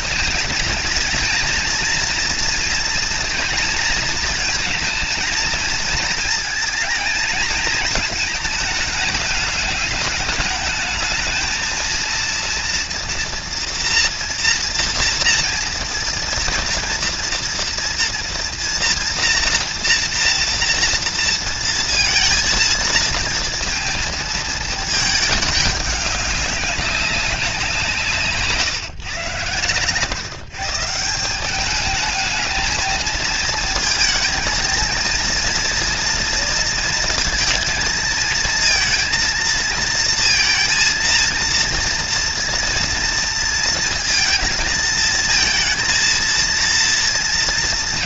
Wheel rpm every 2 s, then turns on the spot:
230, 230, 220, 220, 210, 210, 230, 230, 230, 230, 230, 230, 220, 200, 120, 160, 220, 230, 230, 230, 230, 230, 230, 230.
none